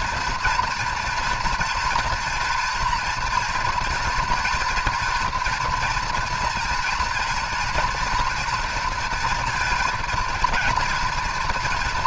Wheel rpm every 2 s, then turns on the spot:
240, 240, 230, 230, 240, 240.
none